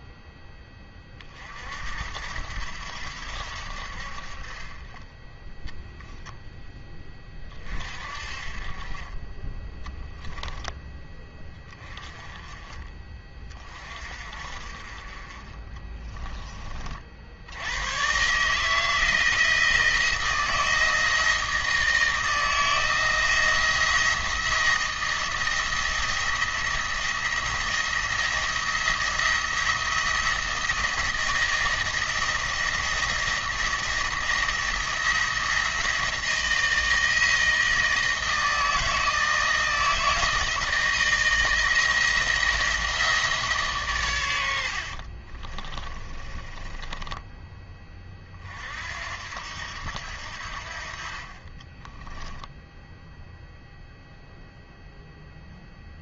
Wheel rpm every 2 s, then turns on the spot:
10, 80, 40, 10, 30, 10, 20, 40, 30, 150, 160, 170, 170, 170, 170, 170, 170, 170, 160, 160, 160, 170, 70, 20, 50, 60, 20, 0.
44-48